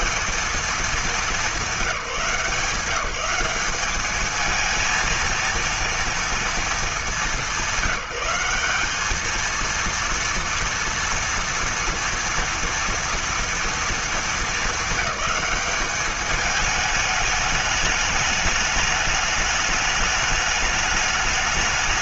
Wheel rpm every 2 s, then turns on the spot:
210, 180, 220, 220, 200, 230, 230, 210, 210, 210, 210.
none